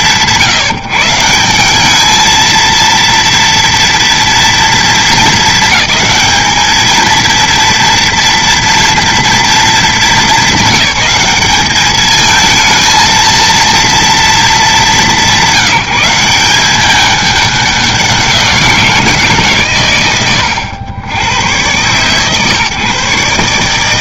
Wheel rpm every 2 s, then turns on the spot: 150, 230, 220, 220, 230, 200, 230, 180, 200, 180, 90, 140.
none